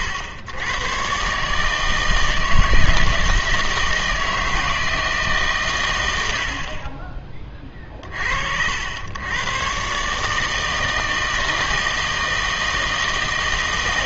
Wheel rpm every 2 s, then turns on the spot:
100, 160, 160, 60, 80, 160, 160.
none